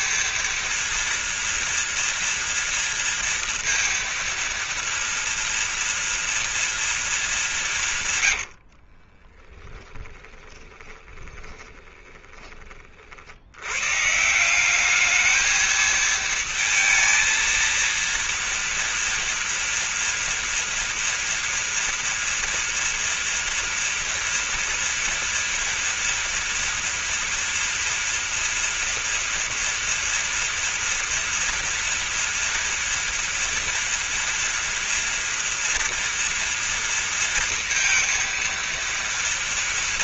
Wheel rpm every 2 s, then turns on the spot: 230, 230, 230, 230, 70, 20, 30, 200, 230, 230, 230, 230, 230, 230, 230, 230, 230, 230, 230, 230.
8-12